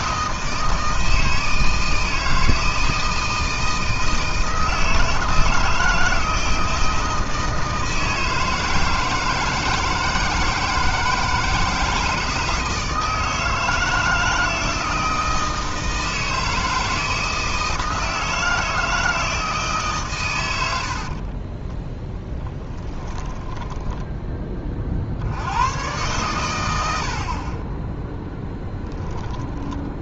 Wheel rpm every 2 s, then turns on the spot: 160, 160, 160, 160, 160, 160, 160, 160, 160, 160, 80, 20, 30, 100, 0.
20-24